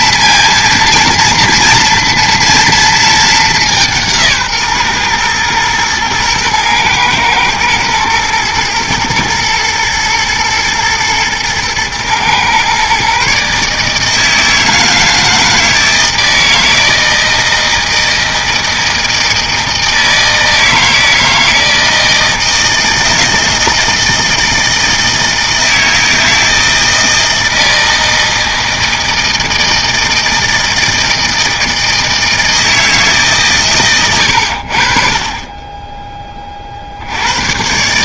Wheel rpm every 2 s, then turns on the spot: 230, 230, 140, 120, 110, 110, 130, 160, 160, 160, 160, 160, 160, 160, 160, 160, 160, 70, 40.
none